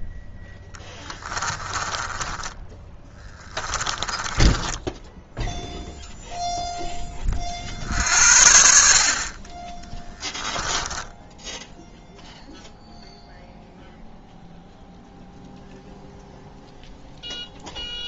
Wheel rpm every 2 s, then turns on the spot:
10, 10, 10, 10, 50, 10, 0, 0, 0.
0-6 10-12